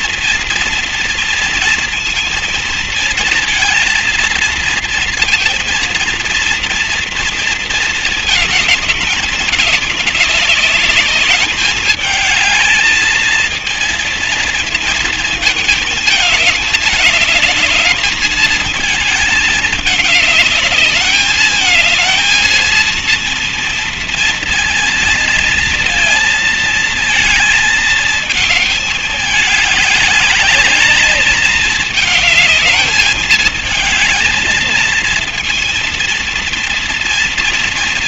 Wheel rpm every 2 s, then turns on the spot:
230, 230, 230, 230, 230, 210, 210, 230, 220, 210, 210, 220, 230, 230, 220, 210, 210, 220, 230.
none